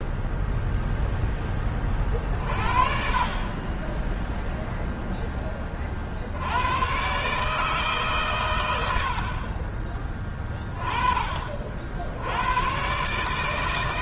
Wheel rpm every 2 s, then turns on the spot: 0, 40, 10, 40, 150, 30, 60.
none